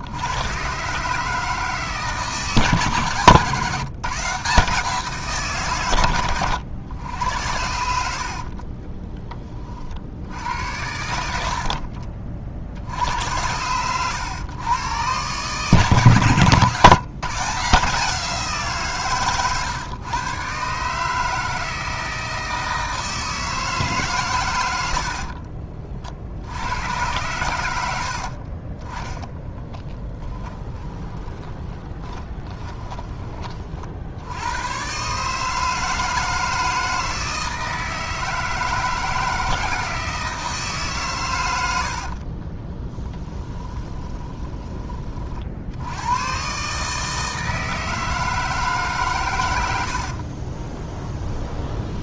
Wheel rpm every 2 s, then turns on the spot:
140, 140, 160, 90, 20, 80, 70, 120, 150, 150, 150, 160, 90, 90, 20, 20, 20, 130, 160, 160, 150, 20, 20, 150, 140, 20.
30-34 42-44 50-52